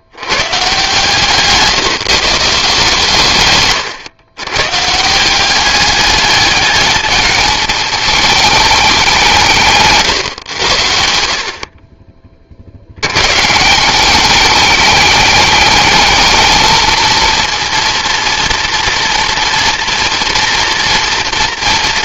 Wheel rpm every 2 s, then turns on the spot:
140, 160, 140, 210, 200, 90, 70, 210, 220, 230, 230.
none